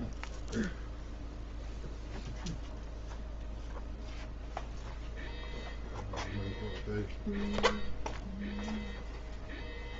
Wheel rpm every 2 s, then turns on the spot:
0, 0, 0, 0, 0.
none